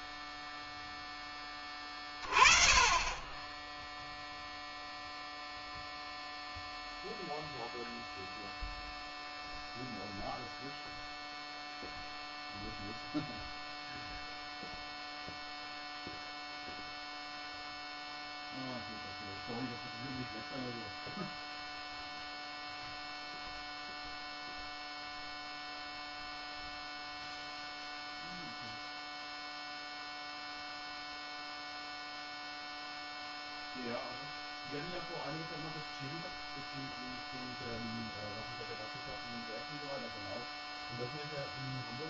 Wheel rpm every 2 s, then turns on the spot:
0, 20, 0, 0, 0, 0, 0, 0, 0, 0, 0, 0, 0, 0, 0, 0, 0, 0, 0, 0, 0.
none